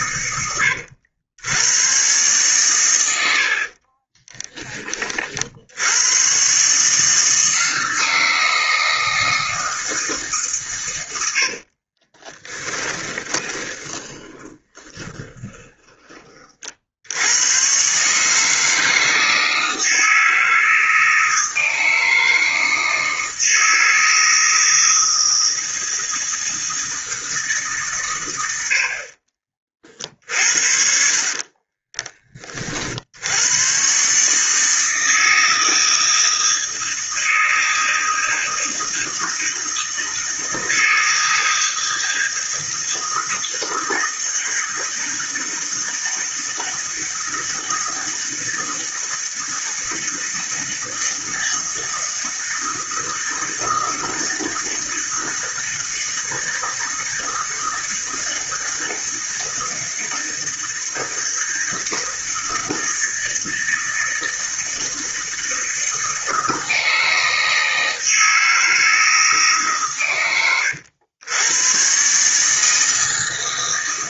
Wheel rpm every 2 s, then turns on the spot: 80, 110, 20, 150, 160, 120, 10, 20, 50, 160, 160, 160, 160, 160, 70, 50, 60, 160, 160, 160, 160, 160, 160, 160, 160, 160, 160, 160, 160, 160, 160, 160, 160, 160, 160, 100, 160.
12-16 30-32